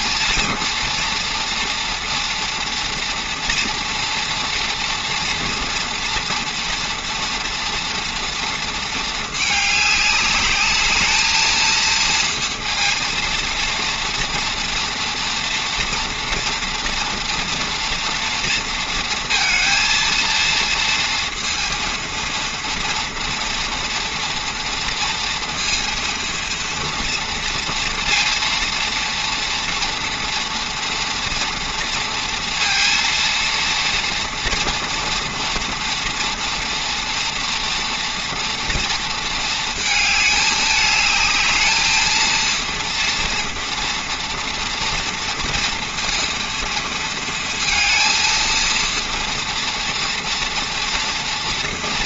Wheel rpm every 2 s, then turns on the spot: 230, 230, 240, 230, 230, 210, 230, 230, 230, 230, 230, 230, 230, 230, 230, 240, 230, 240, 230, 230, 210, 230, 230, 230, 230, 230.
none